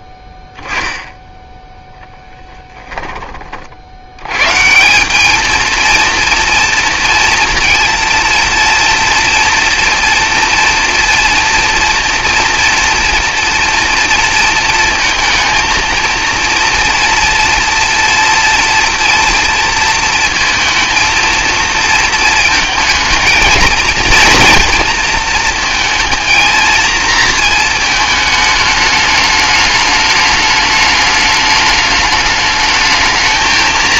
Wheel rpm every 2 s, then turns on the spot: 10, 10, 170, 230, 230, 230, 230, 230, 230, 230, 230, 220, 230, 230, 210, 210, 220.
2-4